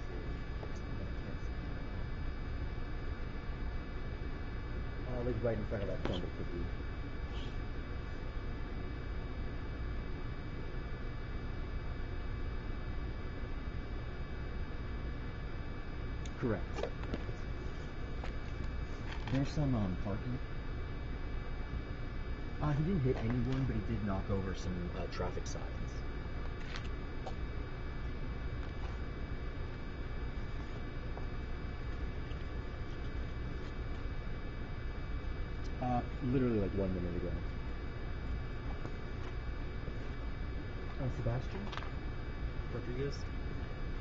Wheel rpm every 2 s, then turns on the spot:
0, 0, 0, 0, 0, 0, 0, 0, 0, 0, 0, 0, 0, 0, 0, 0, 0, 0, 0, 0, 0, 0.
none